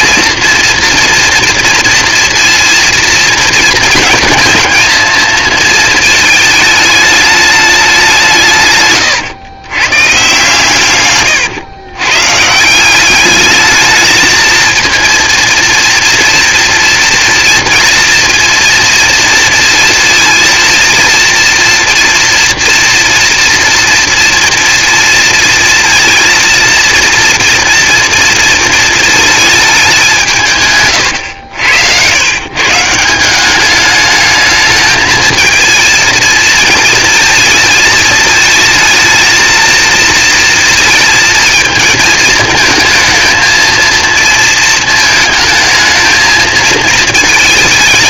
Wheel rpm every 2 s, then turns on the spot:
230, 230, 220, 210, 150, 130, 160, 220, 230, 230, 230, 230, 230, 230, 230, 140, 140, 220, 220, 220, 230, 220, 230, 230.
none